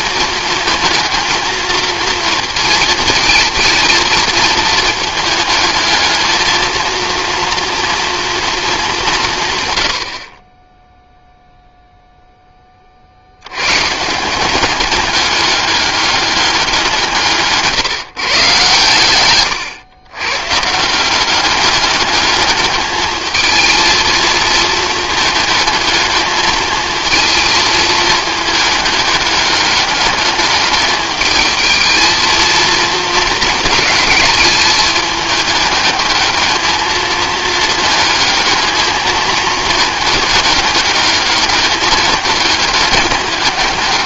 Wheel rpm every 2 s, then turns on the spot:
230, 230, 220, 230, 210, 10, 30, 200, 190, 120, 160, 220, 220, 220, 210, 210, 230, 210, 220, 220, 210, 200.
none